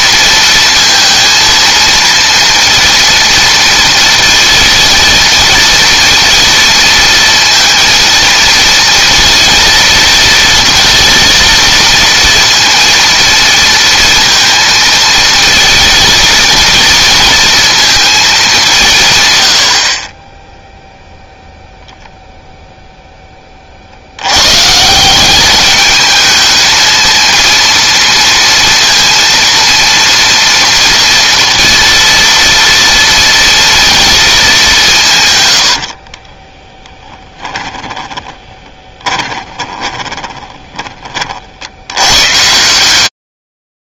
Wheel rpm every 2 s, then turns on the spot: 230, 230, 230, 230, 230, 230, 230, 230, 230, 160, 0, 0, 150, 220, 230, 230, 230, 200, 20, 20, 20, 140.
36-40